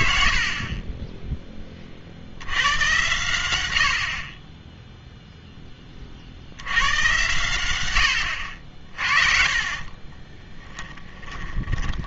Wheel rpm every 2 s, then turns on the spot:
60, 90, 10, 100, 60, 10.
10-12